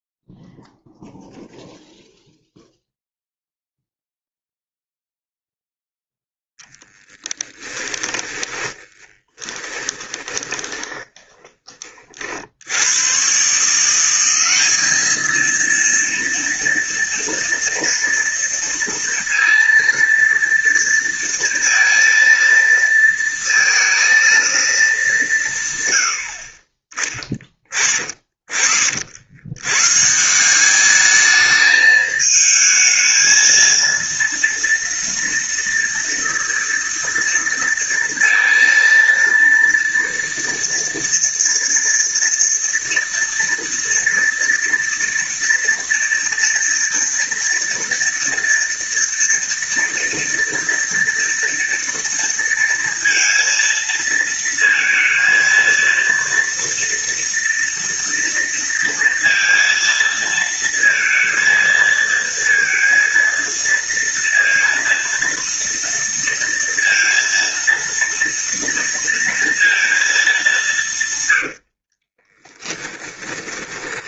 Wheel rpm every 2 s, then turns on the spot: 0, 0, 0, 10, 10, 20, 90, 210, 240, 230, 230, 230, 200, 20, 60, 200, 220, 230, 230, 230, 230, 230, 230, 230, 230, 230, 230, 230, 230, 230, 230, 230, 230, 230, 230, 150, 10.
6-12 72-74